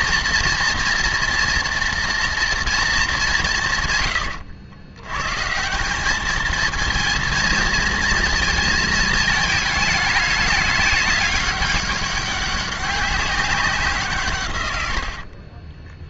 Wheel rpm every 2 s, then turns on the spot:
240, 220, 110, 230, 220, 200, 200, 90.
none